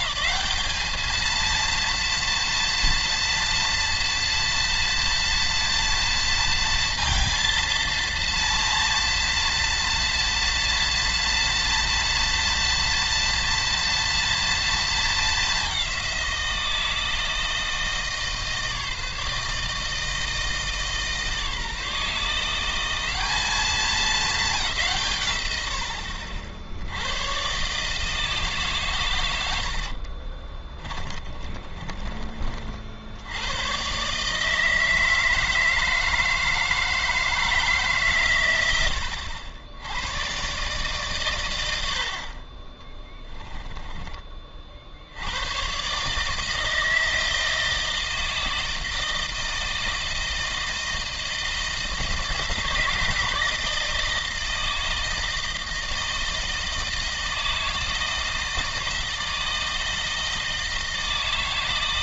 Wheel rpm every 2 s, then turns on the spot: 200, 230, 230, 230, 230, 230, 230, 230, 170, 160, 160, 170, 190, 60, 140, 20, 50, 160, 160, 100, 130, 20, 40, 160, 160, 160, 170, 160, 160, 160, 160.
30-32